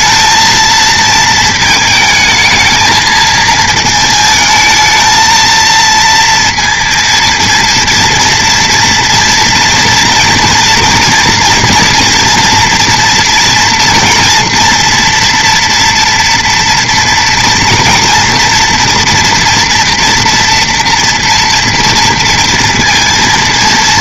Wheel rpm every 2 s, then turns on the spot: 220, 220, 220, 230, 230, 230, 230, 230, 230, 230, 230, 230.
none